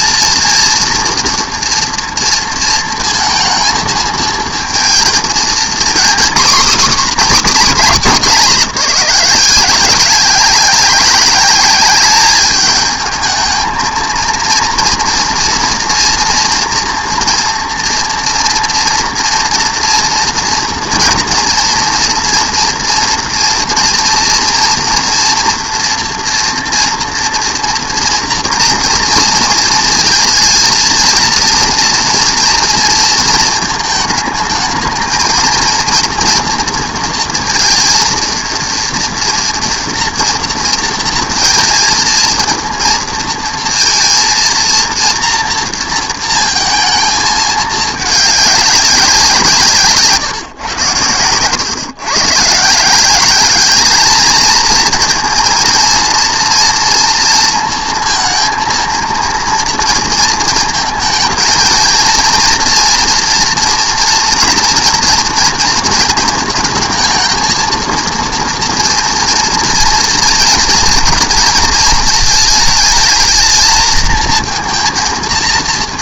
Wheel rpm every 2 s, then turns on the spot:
230, 230, 230, 270, 200, 200, 210, 230, 230, 240, 230, 230, 240, 230, 230, 230, 230, 220, 230, 230, 230, 230, 230, 230, 200, 130, 150, 220, 230, 230, 230, 230, 230, 230, 230, 240, 220, 230.
none